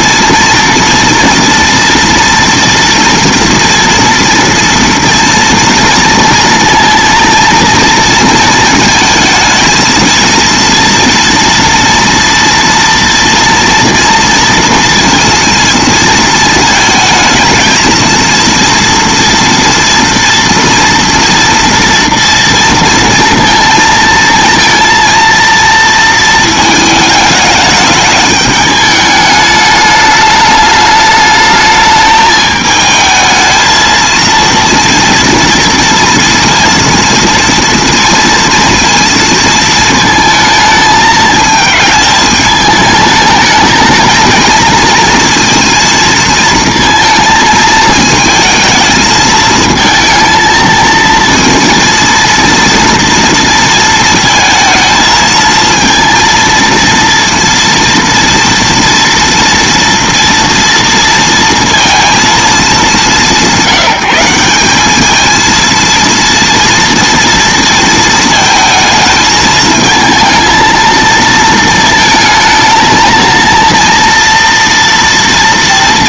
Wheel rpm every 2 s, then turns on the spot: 230, 230, 230, 230, 230, 230, 230, 230, 220, 230, 230, 230, 230, 220, 210, 210, 220, 230, 230, 230, 220, 210, 230, 230, 220, 230, 230, 230, 230, 230, 230, 200, 190, 230, 220, 220, 220, 230.
none